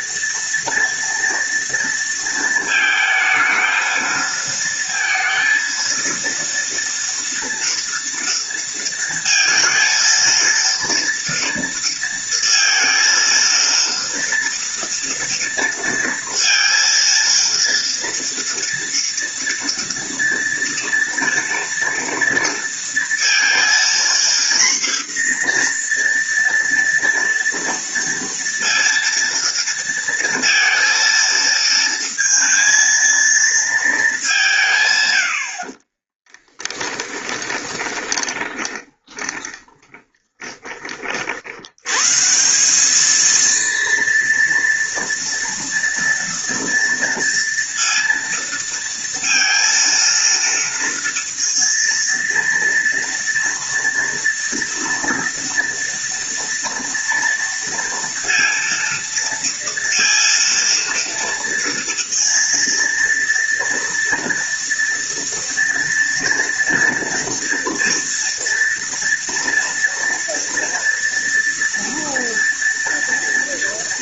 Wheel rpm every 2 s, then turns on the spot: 230, 220, 230, 240, 230, 230, 230, 230, 230, 230, 230, 230, 240, 230, 230, 230, 230, 80, 20, 20, 60, 220, 240, 230, 230, 230, 230, 230, 230, 230, 230, 230, 230, 230, 230, 230, 230.
36-40